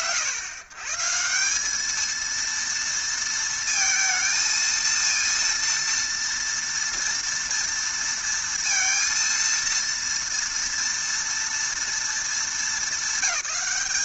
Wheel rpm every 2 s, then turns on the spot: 140, 230, 230, 230, 230, 230, 210.
none